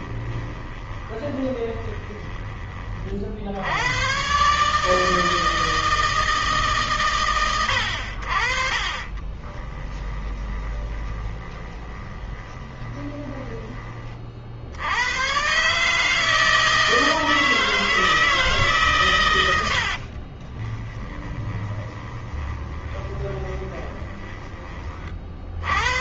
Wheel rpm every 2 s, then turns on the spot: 20, 30, 150, 140, 40, 20, 20, 80, 160, 130, 20, 20, 30.
0-2 8-14 20-24